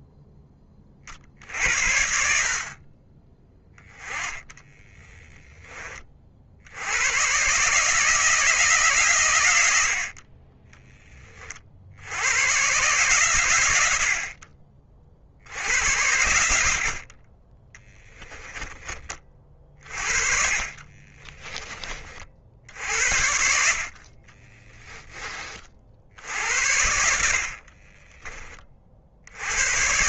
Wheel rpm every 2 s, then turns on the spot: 40, 20, 10, 120, 120, 10, 130, 60, 20, 30, 20, 60, 30, 70, 70.
18-22